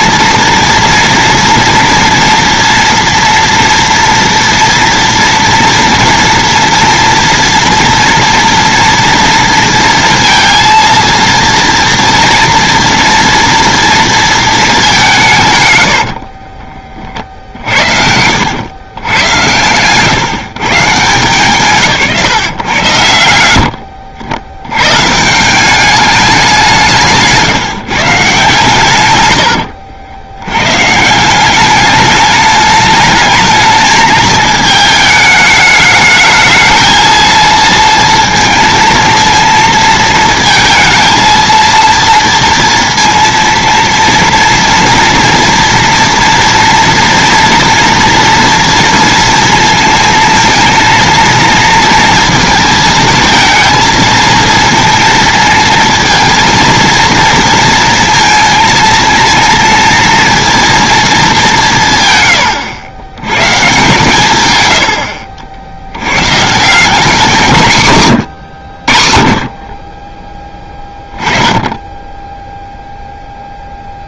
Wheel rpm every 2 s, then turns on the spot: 230, 230, 240, 240, 230, 230, 230, 230, 90, 80, 140, 140, 80, 200, 150, 90, 210, 220, 220, 230, 230, 230, 230, 240, 240, 230, 230, 230, 230, 230, 230, 120, 140, 150, 100, 10, 0.
16-18